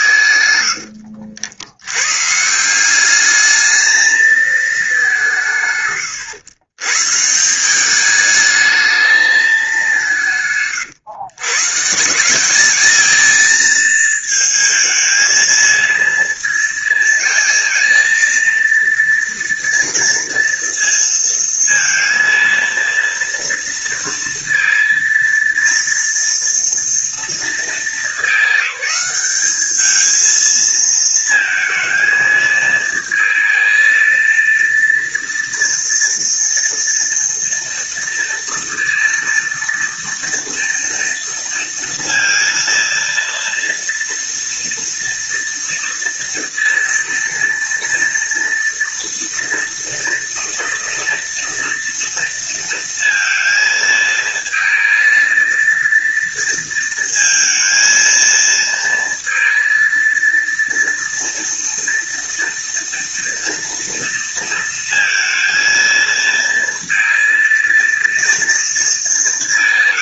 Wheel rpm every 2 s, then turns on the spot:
110, 160, 220, 110, 210, 150, 210, 220, 230, 230, 230, 230, 230, 230, 210, 220, 230, 230, 230, 230, 230, 230, 230, 230, 230, 230, 230, 220, 230, 230, 230, 230, 230, 230, 230.
0-2